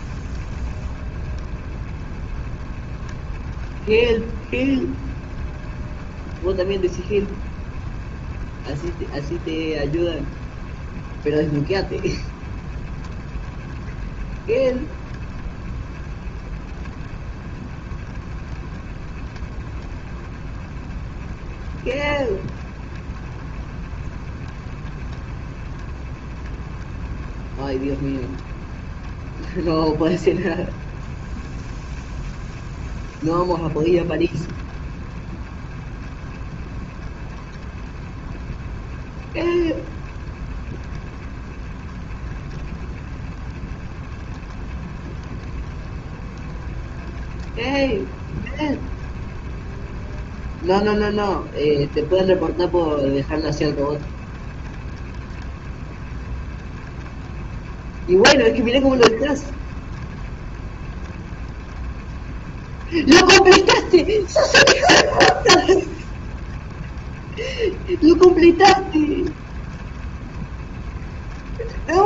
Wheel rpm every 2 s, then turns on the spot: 30, 30, 30, 20, 20, 30, 20, 30, 30, 30, 20, 30, 30, 30, 30, 30, 30, 30, 30, 30, 30, 30, 30, 30, 30, 30, 30, 30, 30, 30, 30, 30, 30, 20, 30, 30.
0-72